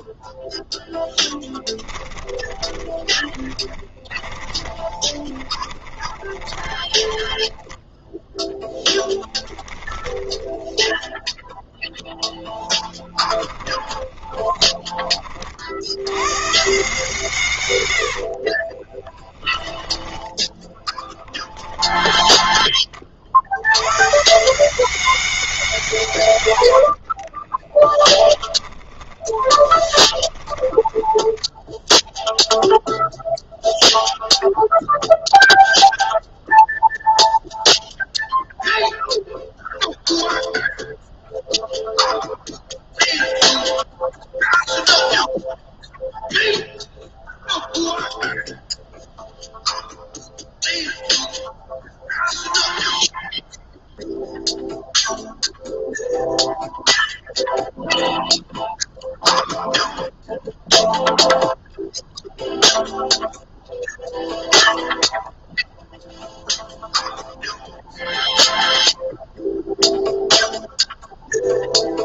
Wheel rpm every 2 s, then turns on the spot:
0, 10, 20, 20, 10, 10, 0, 30, 130, 20, 10, 40, 180, 50, 30, 10, 0, 0, 0, 0, 0, 0, 0, 0, 0, 0, 0, 0, 0, 0, 0, 0, 0, 0, 0, 0.
2-12 18-22 26-32